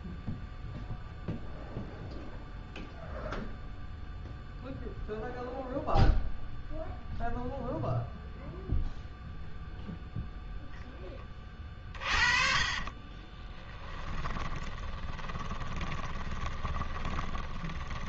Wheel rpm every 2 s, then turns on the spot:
0, 0, 0, 0, 0, 10, 30, 20, 20.
12-18